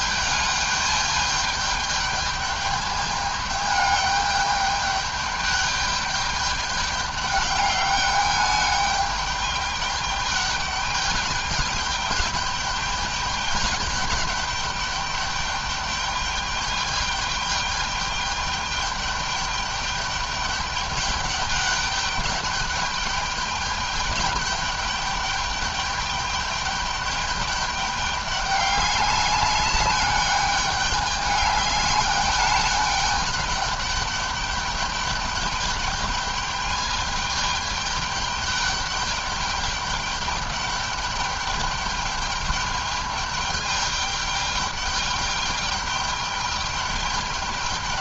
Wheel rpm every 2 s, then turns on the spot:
210, 210, 200, 210, 210, 200, 210, 200, 210, 210, 210, 200, 200, 210, 200, 210, 210, 210, 210, 210, 200, 210, 210, 210.
none